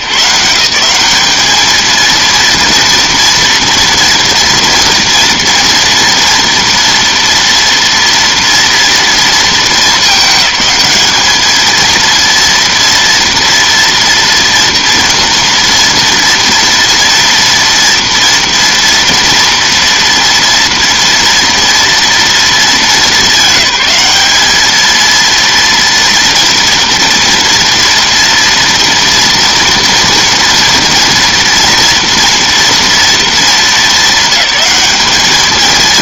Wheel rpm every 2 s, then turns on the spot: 170, 230, 230, 240, 230, 210, 230, 230, 230, 230, 230, 220, 220, 240, 230, 230, 230, 210.
none